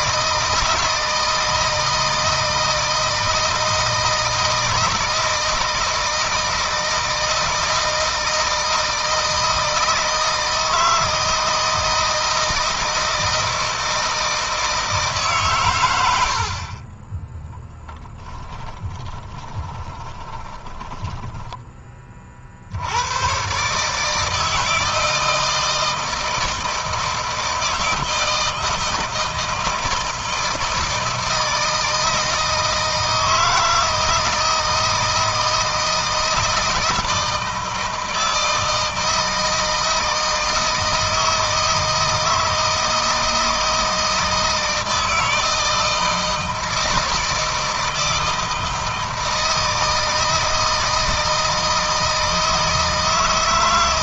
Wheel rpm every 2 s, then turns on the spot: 160, 160, 160, 160, 160, 160, 160, 150, 40, 10, 10, 80, 160, 160, 160, 160, 160, 160, 160, 160, 160, 160, 160, 160, 160, 160, 160.
18-22